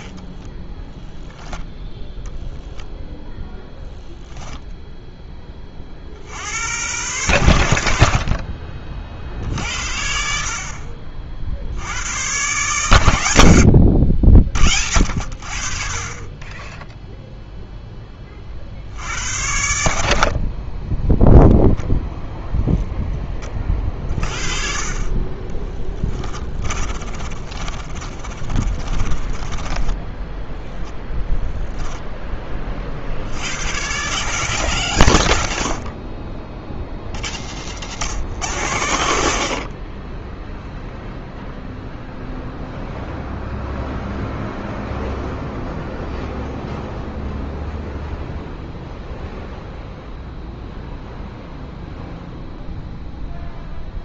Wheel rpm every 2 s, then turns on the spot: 10, 0, 0, 90, 40, 50, 120, 60, 10, 60, 10, 0, 40, 30, 30, 0, 40, 140, 40, 100, 0, 0, 0, 0, 0, 0, 0.
26-30